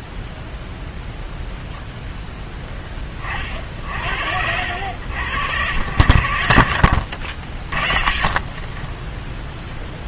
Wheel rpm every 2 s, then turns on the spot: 0, 20, 80, 60, 20.
none